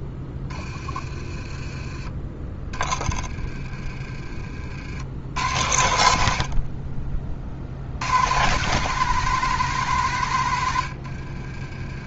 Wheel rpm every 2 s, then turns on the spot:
30, 20, 70, 40, 150, 90.
0-2 10-12